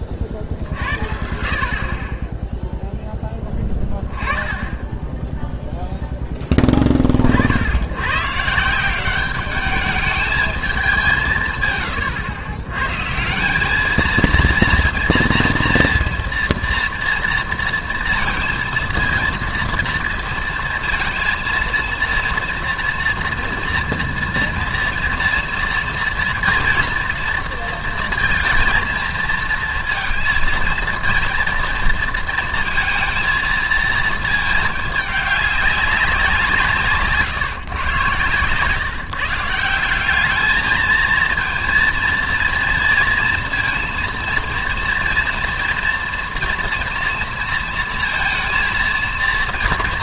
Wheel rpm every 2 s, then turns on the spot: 60, 10, 10, 20, 160, 210, 120, 230, 230, 230, 230, 240, 240, 230, 230, 230, 230, 220, 170, 130, 210, 230, 230, 230, 230.
38-40